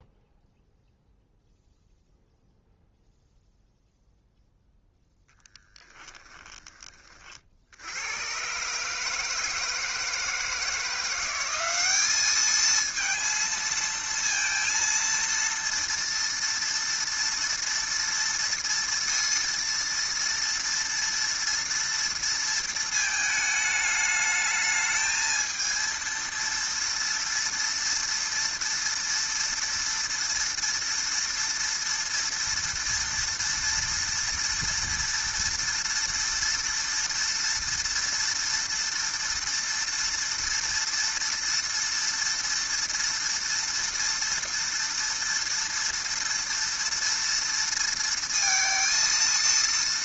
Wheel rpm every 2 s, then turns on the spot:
0, 0, 0, 20, 140, 170, 220, 230, 230, 230, 230, 230, 210, 230, 230, 230, 230, 230, 230, 230, 230, 230, 230, 230, 230.
none